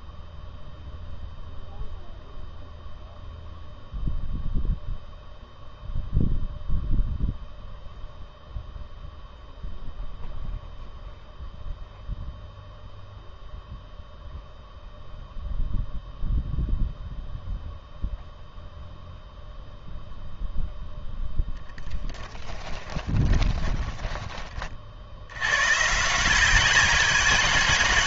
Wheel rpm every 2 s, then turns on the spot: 0, 0, 0, 0, 0, 0, 0, 0, 0, 0, 0, 20, 30, 190.
22-24